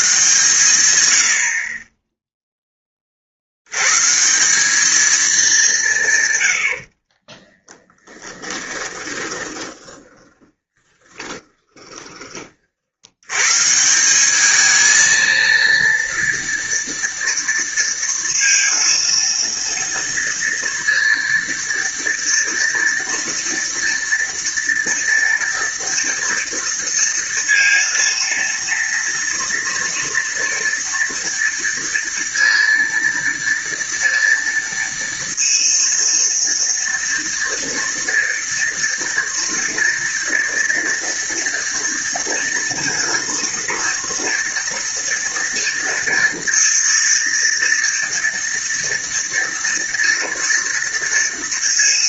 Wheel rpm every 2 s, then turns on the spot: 120, 10, 190, 90, 10, 20, 50, 210, 230, 230, 230, 230, 230, 230, 230, 230, 230, 230, 230, 230, 230, 230, 230, 230, 230, 230.
6-12